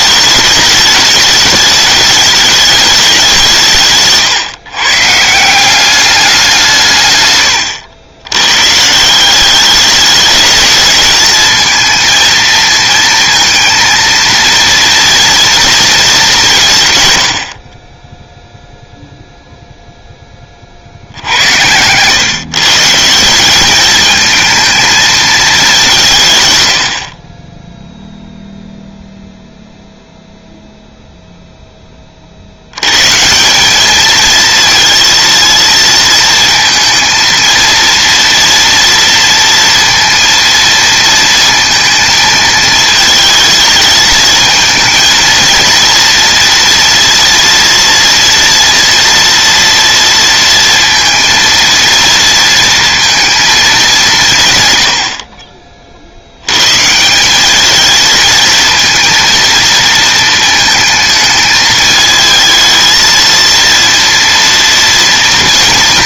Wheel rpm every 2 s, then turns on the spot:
210, 210, 140, 180, 130, 210, 230, 230, 170, 0, 40, 130, 220, 120, 0, 0, 70, 230, 230, 230, 230, 220, 220, 230, 230, 230, 230, 120, 100, 220, 230, 220, 230.
none